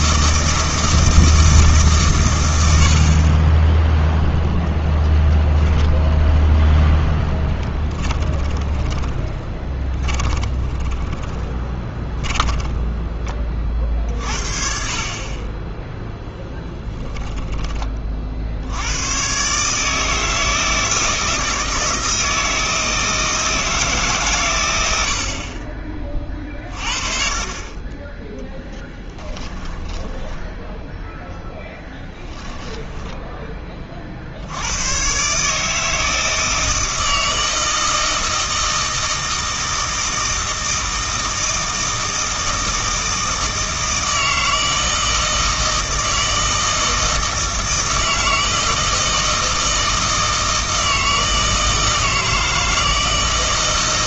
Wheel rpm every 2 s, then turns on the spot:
160, 90, 0, 0, 20, 20, 10, 50, 10, 80, 160, 160, 110, 30, 10, 10, 10, 90, 160, 160, 160, 160, 160, 160, 160, 160, 160.
8-14 16-18 28-34